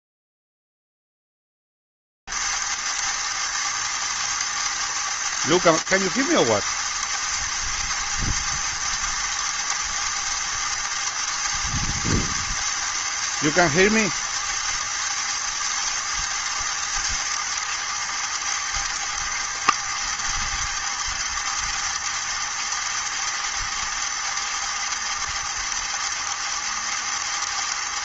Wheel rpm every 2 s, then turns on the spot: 140, 210, 220, 220, 210, 210, 210, 210, 210, 220, 210, 210, 210, 210.
none